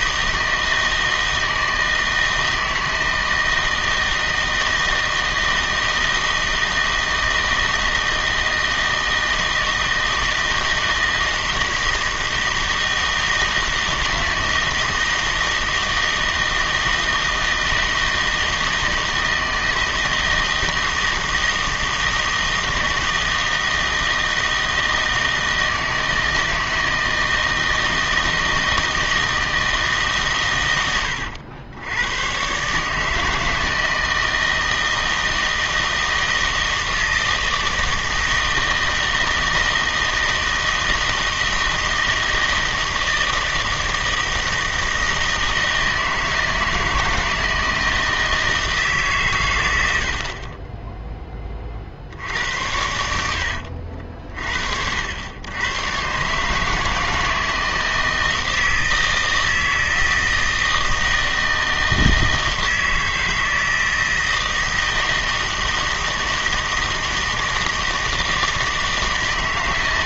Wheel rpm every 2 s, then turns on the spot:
160, 160, 160, 160, 160, 160, 160, 160, 160, 160, 160, 160, 160, 160, 160, 110, 140, 160, 160, 160, 160, 160, 160, 160, 160, 20, 70, 60, 150, 160, 160, 160, 160, 160, 160.
50-54